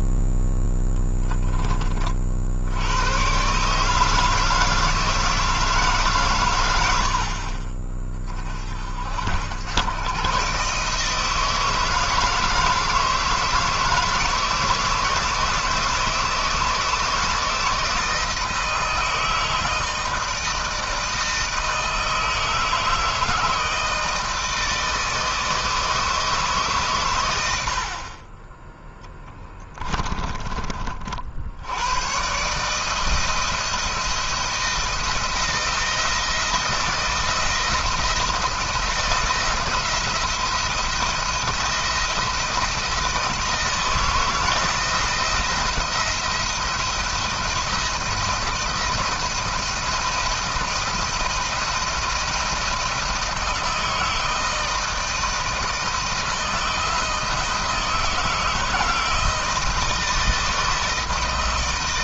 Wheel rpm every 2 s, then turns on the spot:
0, 100, 160, 80, 60, 150, 160, 160, 160, 160, 160, 160, 160, 130, 10, 40, 150, 160, 160, 170, 170, 170, 170, 160, 170, 170, 160, 160, 160, 160, 150.
28-30